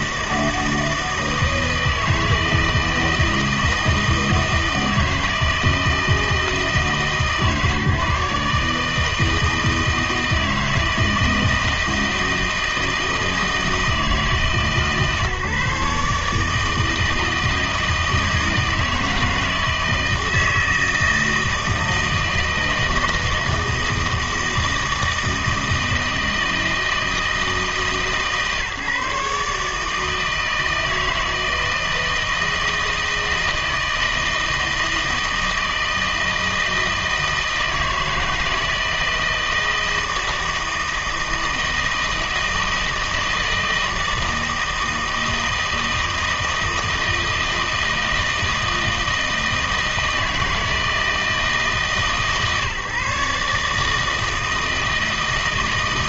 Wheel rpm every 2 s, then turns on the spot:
160, 160, 160, 160, 150, 160, 160, 150, 160, 160, 160, 160, 160, 160, 150, 160, 160, 160, 160, 160, 160, 160, 160, 160, 160, 160, 140, 160.
none